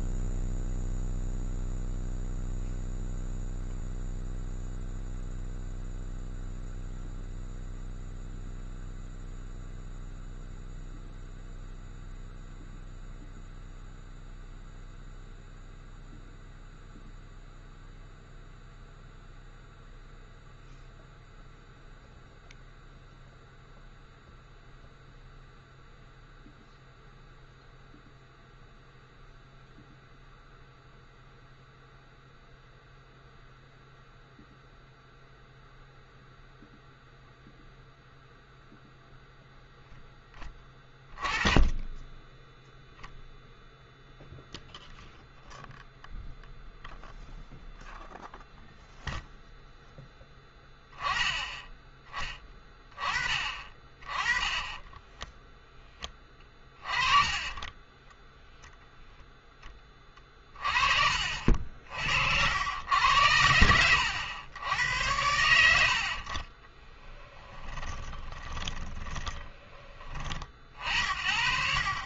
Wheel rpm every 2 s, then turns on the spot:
0, 0, 0, 0, 0, 0, 0, 0, 0, 0, 0, 0, 0, 0, 0, 0, 0, 0, 0, 0, 10, 0, 0, 0, 0, 10, 20, 20, 30, 0, 30, 80, 90, 40, 20, 50.
68-70